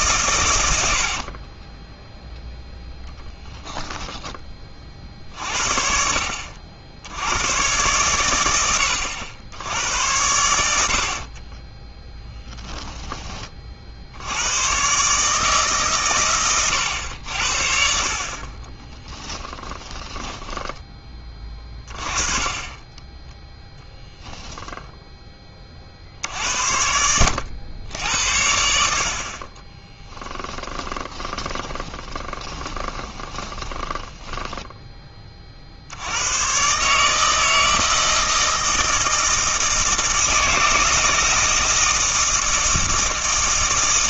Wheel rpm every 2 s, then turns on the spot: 80, 0, 40, 70, 100, 60, 10, 120, 100, 30, 20, 20, 0, 80, 60, 30, 20, 10, 130, 160, 160, 160.
0-2 18-20 30-34